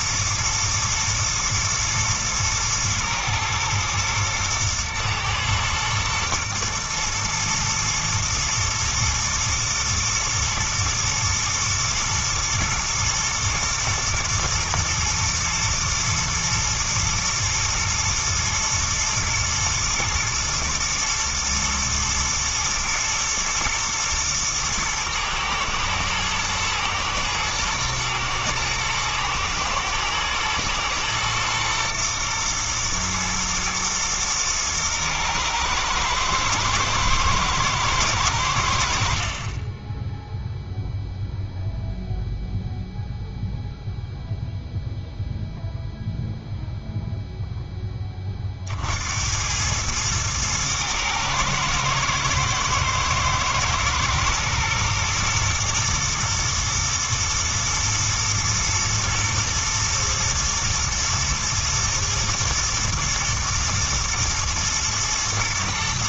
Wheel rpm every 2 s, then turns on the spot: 120, 110, 110, 110, 120, 120, 110, 110, 120, 110, 120, 110, 110, 120, 110, 120, 110, 110, 110, 60, 0, 0, 0, 0, 70, 110, 110, 110, 110, 110, 110, 110, 110.
none